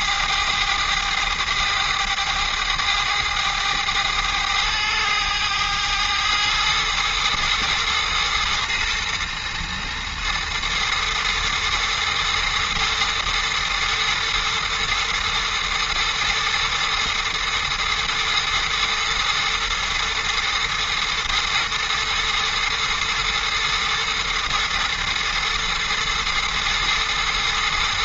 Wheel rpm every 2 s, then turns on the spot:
110, 110, 100, 110, 120, 110, 110, 120, 120, 110, 110, 120, 120, 120.
none